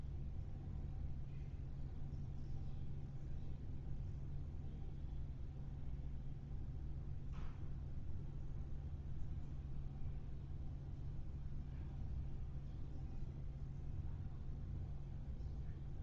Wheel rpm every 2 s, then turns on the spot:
0, 0, 0, 0, 0, 0, 0, 0.
none